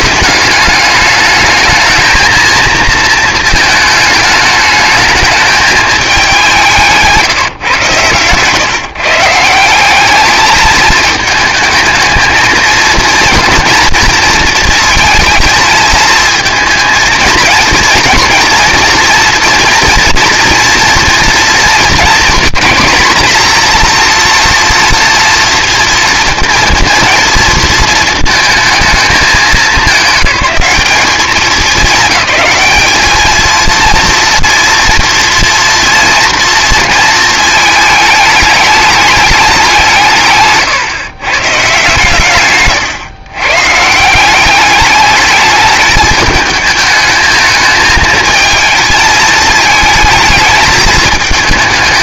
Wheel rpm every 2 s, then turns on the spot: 210, 230, 220, 180, 140, 220, 220, 220, 230, 240, 230, 240, 240, 230, 220, 190, 210, 230, 230, 210, 140, 130, 200, 220, 220, 220.
42-44